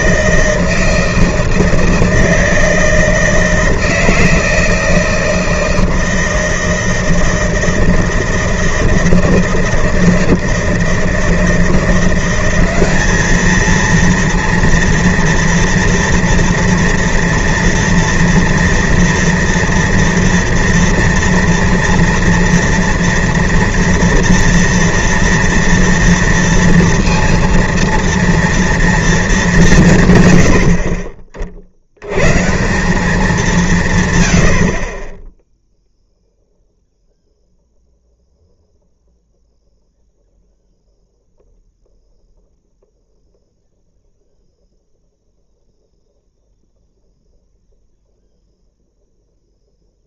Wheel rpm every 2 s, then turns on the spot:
160, 160, 160, 160, 160, 160, 190, 230, 230, 230, 230, 230, 230, 230, 230, 90, 150, 60, 0, 0, 0, 0, 0, 0, 0.
none